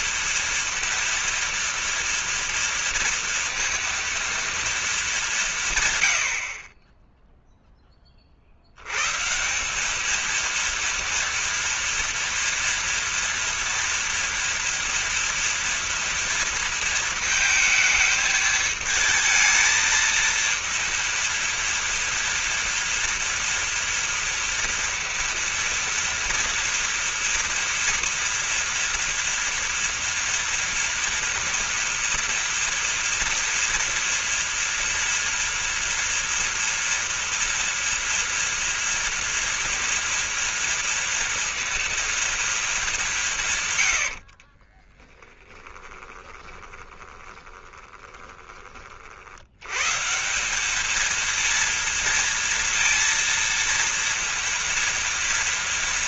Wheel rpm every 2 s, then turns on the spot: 230, 230, 230, 60, 60, 230, 230, 230, 230, 220, 230, 230, 230, 230, 230, 230, 230, 240, 230, 230, 230, 230, 50, 20, 30, 190, 230, 230.
44-48